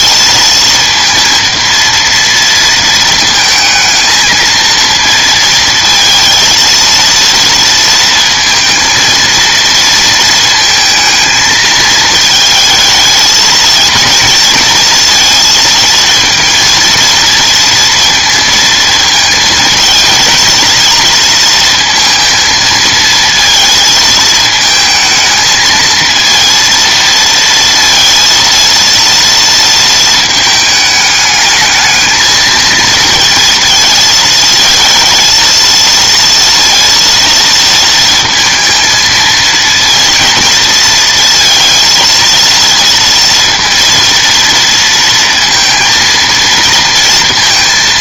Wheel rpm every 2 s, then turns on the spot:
230, 230, 220, 230, 230, 220, 220, 230, 230, 230, 230, 230, 220, 230, 230, 220, 220, 230, 230, 220, 230, 230, 230, 230.
none